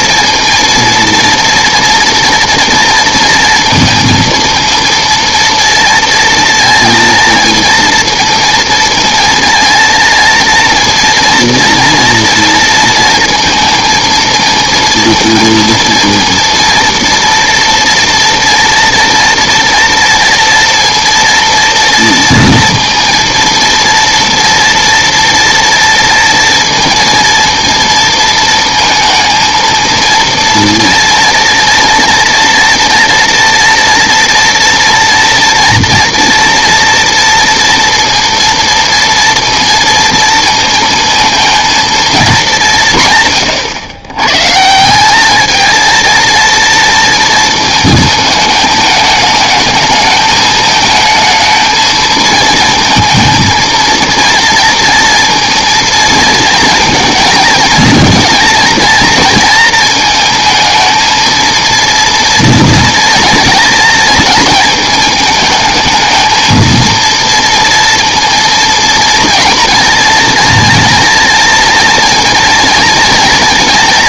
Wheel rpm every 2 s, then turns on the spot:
230, 230, 230, 230, 230, 230, 230, 230, 230, 230, 240, 230, 240, 230, 230, 230, 240, 230, 230, 230, 230, 210, 120, 230, 220, 220, 230, 230, 230, 230, 220, 230, 230, 220, 220, 230, 240.
none